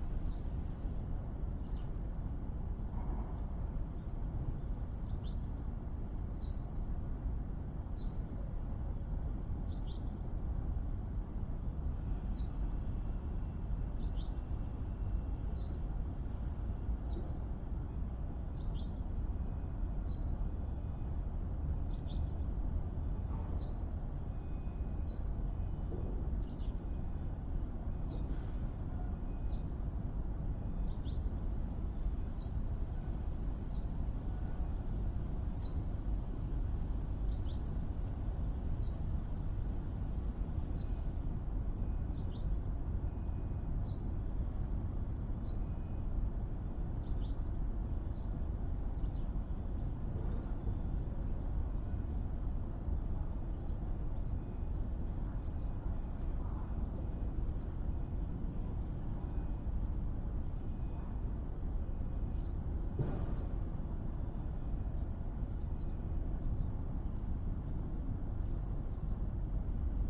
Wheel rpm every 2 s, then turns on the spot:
0, 0, 0, 0, 0, 0, 0, 0, 0, 0, 0, 0, 0, 0, 0, 0, 0, 0, 0, 0, 0, 0, 0, 0, 0, 0, 0, 0, 0, 0, 0, 0, 0, 0, 0.
none